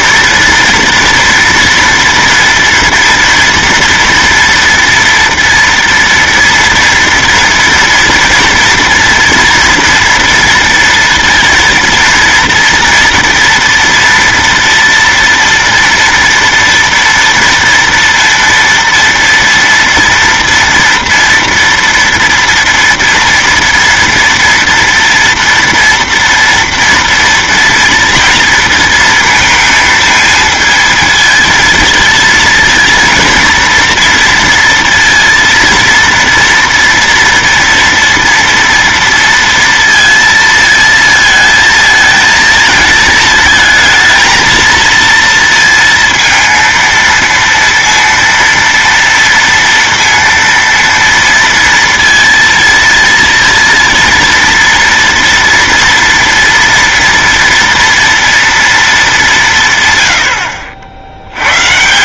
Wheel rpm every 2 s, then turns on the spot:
230, 230, 230, 230, 230, 230, 230, 230, 230, 230, 240, 230, 230, 230, 230, 220, 230, 230, 240, 230, 230, 220, 230, 230, 230, 230, 230, 230, 240, 230, 60.
none